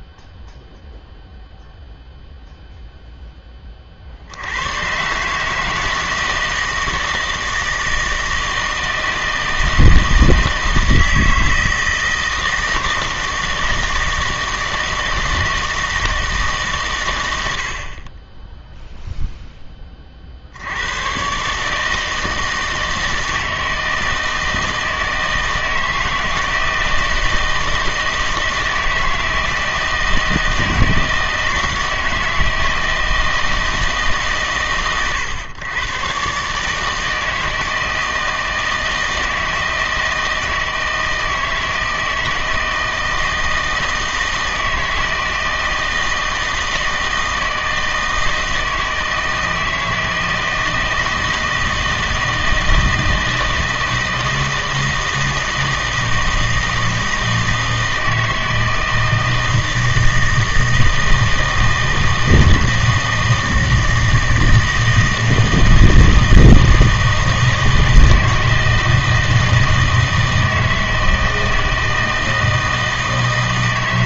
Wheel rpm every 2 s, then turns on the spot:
0, 0, 130, 160, 160, 160, 160, 160, 110, 0, 110, 160, 160, 160, 160, 160, 160, 120, 150, 160, 160, 160, 160, 160, 160, 160, 160, 160, 160, 160, 160, 160, 160, 160, 160, 160, 160.
none